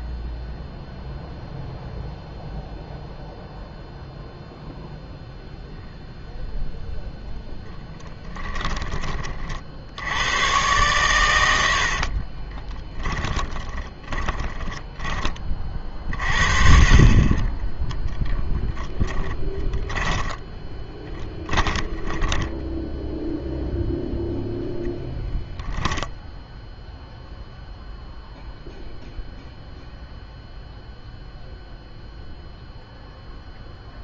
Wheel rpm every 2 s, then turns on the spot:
0, 0, 0, 0, 10, 110, 10, 20, 40, 20, 10, 10, 0, 0, 0, 0, 0.
12-16 18-22